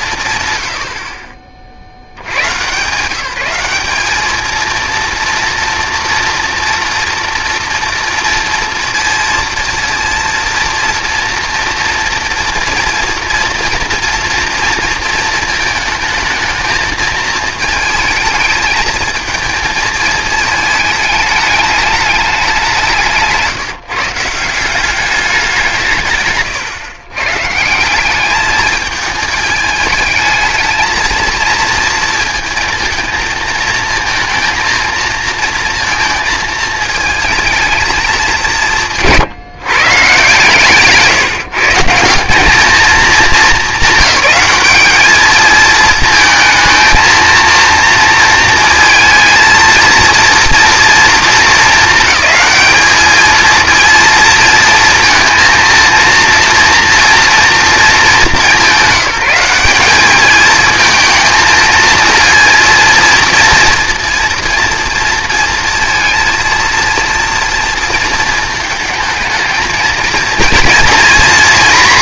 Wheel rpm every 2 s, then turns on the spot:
100, 130, 220, 230, 230, 230, 230, 230, 220, 220, 220, 200, 180, 130, 210, 220, 230, 230, 220, 170, 140, 200, 200, 230, 230, 230, 210, 220, 230, 210, 220, 230, 230, 230, 220, 230.
40-42